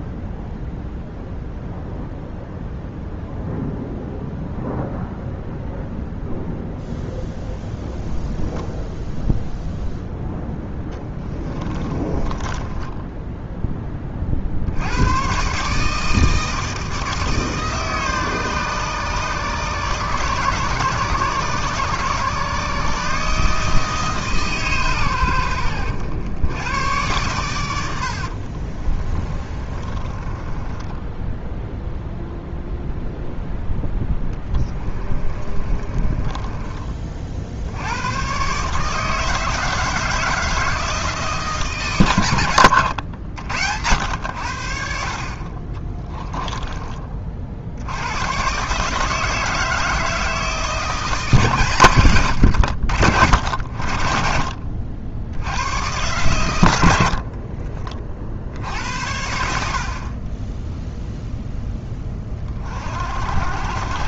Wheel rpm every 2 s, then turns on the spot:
0, 0, 0, 0, 10, 10, 10, 80, 160, 140, 140, 150, 130, 110, 40, 10, 0, 20, 30, 150, 160, 100, 60, 20, 150, 160, 80, 50, 90, 70, 0, 40.
10-14 28-32 34-36 42-44